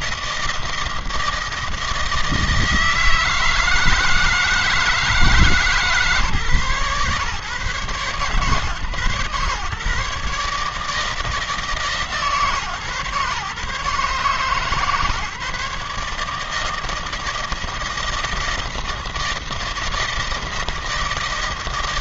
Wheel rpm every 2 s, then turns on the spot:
160, 160, 160, 130, 140, 150, 140, 150, 160, 160, 160.
none